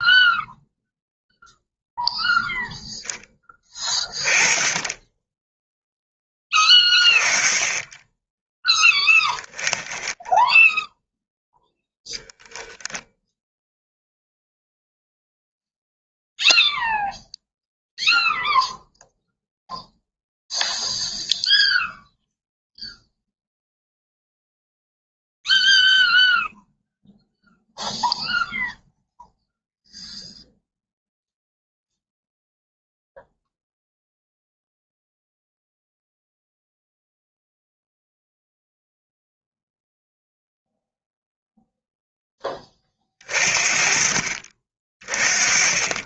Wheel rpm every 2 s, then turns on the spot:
0, 0, 10, 20, 10, 0, 0, 0, 0, 0, 0, 0, 0, 0, 0, 0, 0, 0, 0, 0, 0, 20, 30.
8-10